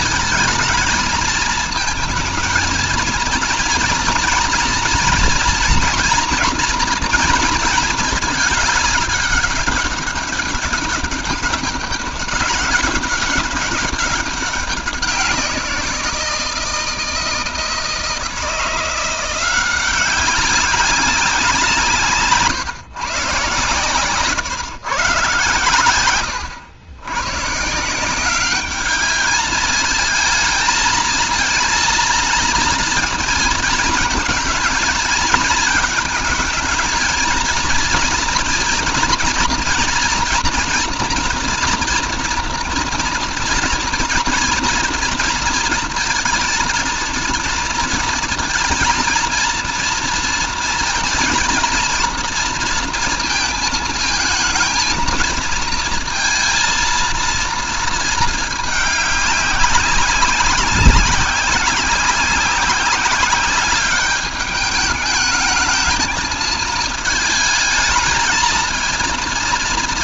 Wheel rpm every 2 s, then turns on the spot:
220, 230, 240, 240, 210, 200, 190, 180, 160, 170, 190, 130, 130, 130, 210, 230, 230, 230, 230, 230, 230, 230, 230, 230, 230, 230, 230, 230, 230, 200, 180, 190, 210, 220, 230.
none